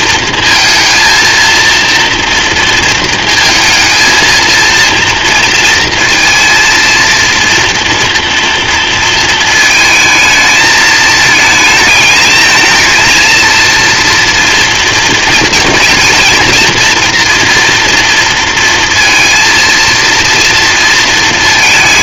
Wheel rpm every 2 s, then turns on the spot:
230, 230, 230, 230, 230, 220, 220, 230, 230, 230, 230.
none